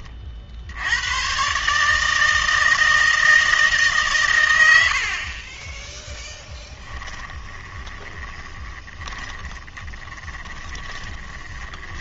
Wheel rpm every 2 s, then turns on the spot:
80, 160, 90, 10, 20, 20.
6-12